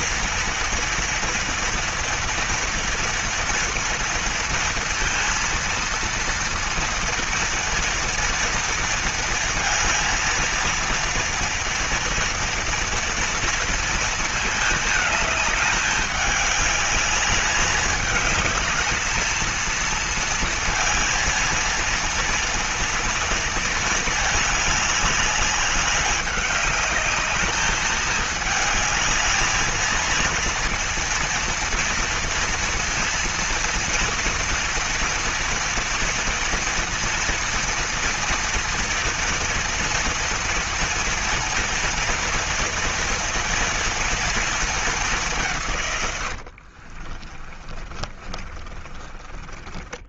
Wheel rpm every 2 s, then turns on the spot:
230, 240, 230, 230, 230, 230, 230, 220, 210, 210, 230, 230, 210, 200, 210, 230, 230, 230, 230, 230, 230, 230, 230, 100, 30.
46-50